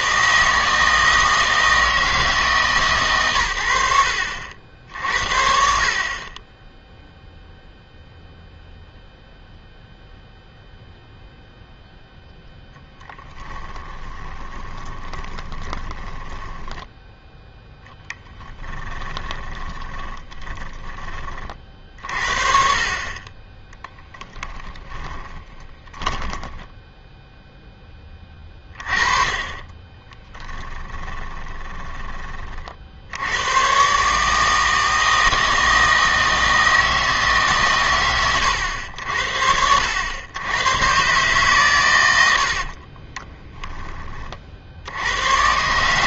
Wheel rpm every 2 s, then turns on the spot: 160, 140, 70, 10, 0, 0, 0, 20, 10, 10, 30, 50, 20, 10, 30, 20, 50, 160, 160, 90, 110, 60, 80.
14-22 24-28 30-32 42-44